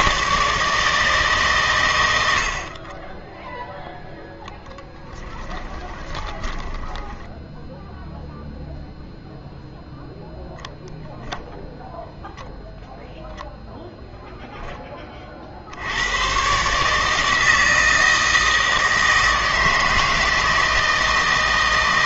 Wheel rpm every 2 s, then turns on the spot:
160, 50, 10, 10, 0, 0, 0, 10, 140, 160, 160.
4-8